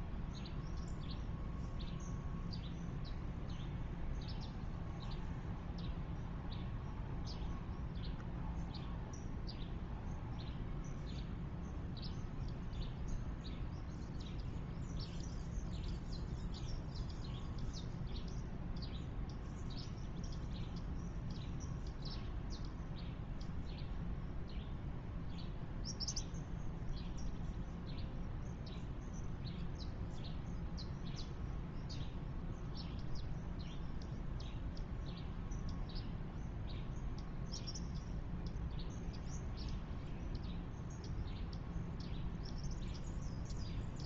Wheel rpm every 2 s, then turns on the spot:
0, 0, 0, 0, 0, 0, 0, 0, 0, 0, 0, 0, 0, 0, 0, 0, 0, 0, 0, 0, 0, 0.
none